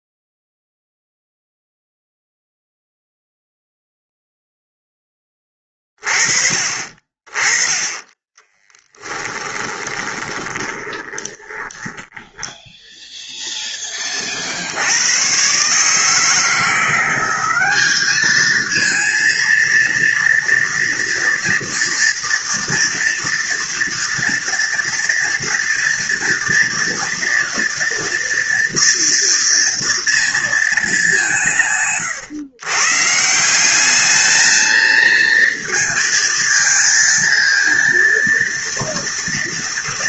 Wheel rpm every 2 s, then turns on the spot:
0, 0, 0, 40, 10, 20, 10, 60, 170, 220, 230, 230, 230, 230, 230, 220, 120, 220, 220, 230.
8-14